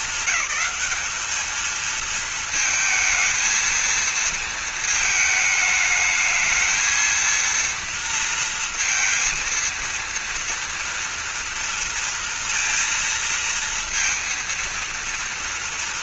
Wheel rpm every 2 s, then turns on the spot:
210, 220, 220, 220, 230, 230, 230, 230.
none